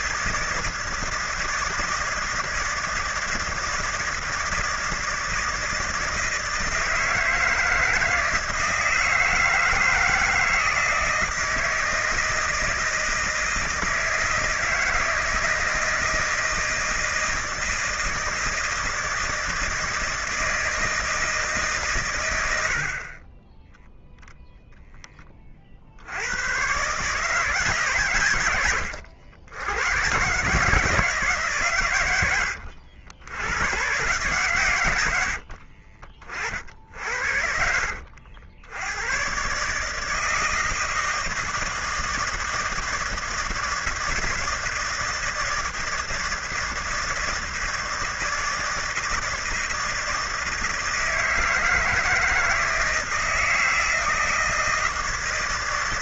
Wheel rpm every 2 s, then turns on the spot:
160, 160, 160, 160, 160, 160, 160, 160, 160, 160, 160, 80, 0, 110, 110, 150, 100, 120, 60, 80, 160, 160, 160, 160, 160, 160, 160, 160.
none